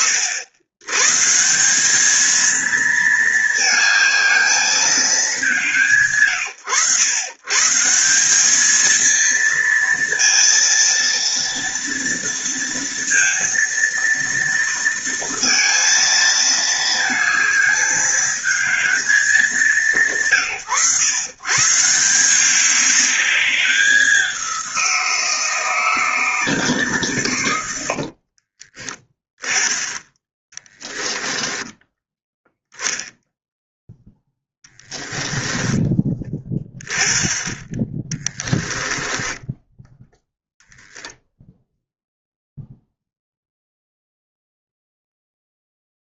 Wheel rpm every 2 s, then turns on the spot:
140, 220, 220, 120, 220, 230, 230, 230, 220, 210, 120, 200, 180, 130, 10, 10, 0, 10, 20, 10, 20, 0, 0.
30-32 34-36 38-42